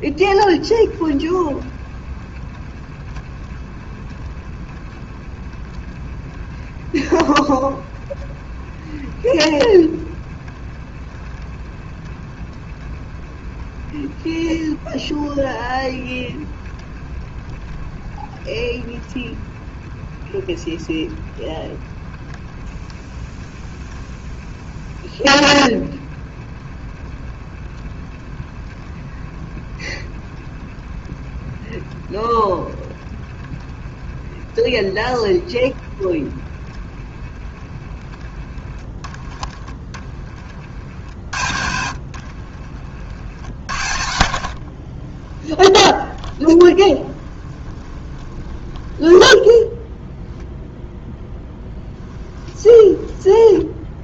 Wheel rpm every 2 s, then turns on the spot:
20, 20, 30, 30, 30, 30, 30, 30, 30, 30, 30, 30, 30, 30, 30, 30, 30, 30, 30, 20, 50, 50, 40, 20, 20, 0, 10.
0-38 40-50 52-54